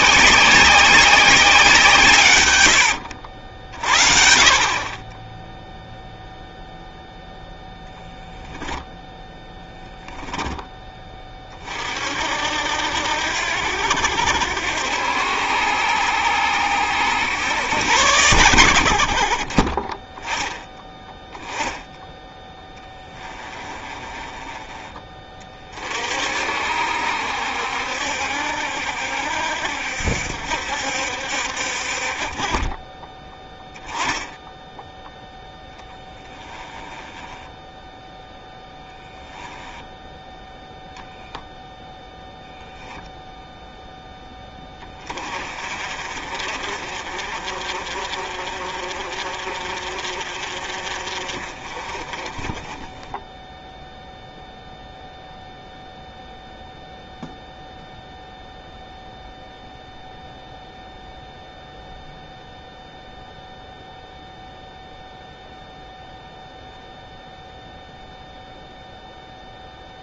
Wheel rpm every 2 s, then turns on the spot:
190, 80, 30, 0, 0, 10, 80, 80, 80, 90, 10, 10, 20, 60, 60, 60, 30, 0, 20, 0, 0, 0, 30, 50, 50, 40, 20, 0, 0, 0, 0, 0, 0, 0, 0.
2-4 22-24 36-38